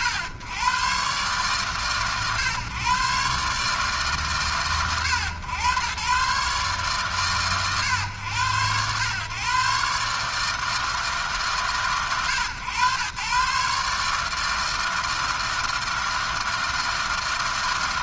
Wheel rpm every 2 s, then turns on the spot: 110, 130, 120, 130, 110, 150, 110, 160, 160.
none